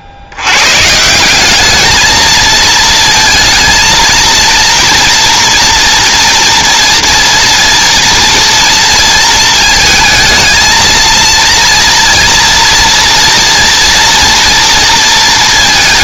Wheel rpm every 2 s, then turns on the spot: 90, 220, 230, 230, 230, 220, 230, 230.
none